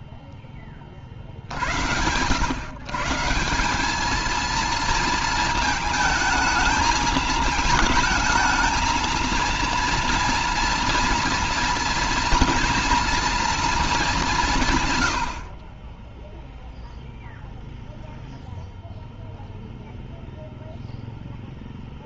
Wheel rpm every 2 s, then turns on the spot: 50, 170, 230, 220, 230, 240, 230, 60, 0, 0, 10.
none